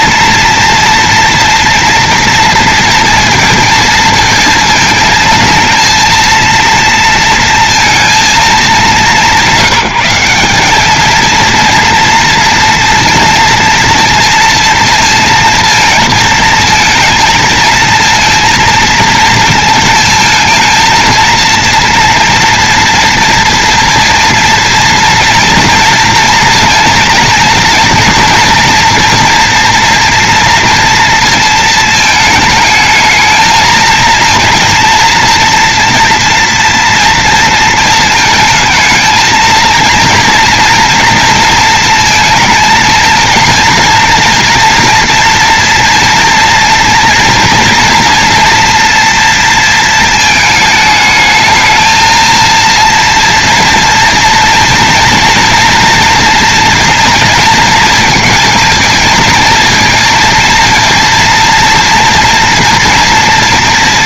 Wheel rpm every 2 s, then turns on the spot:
230, 230, 220, 230, 190, 190, 230, 230, 220, 230, 230, 230, 230, 230, 240, 240, 220, 230, 230, 220, 230, 220, 230, 230, 230, 220, 230, 240, 230, 230, 230, 230.
none